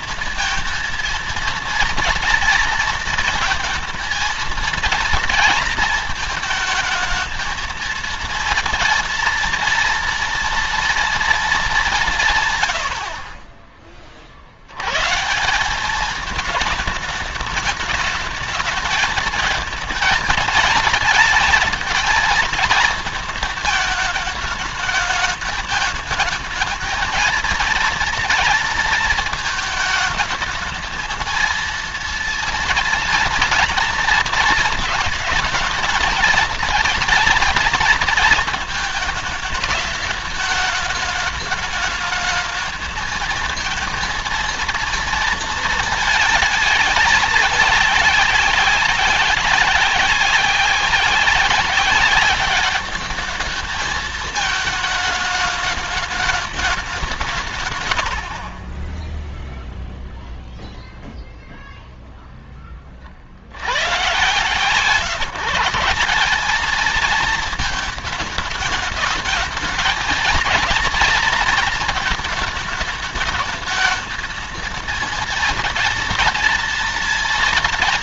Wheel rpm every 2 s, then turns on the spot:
230, 230, 230, 230, 230, 240, 130, 80, 220, 210, 210, 230, 220, 220, 230, 220, 230, 220, 230, 220, 210, 220, 230, 220, 200, 190, 200, 220, 210, 50, 0, 10, 140, 200, 220, 220, 210, 230, 240.
none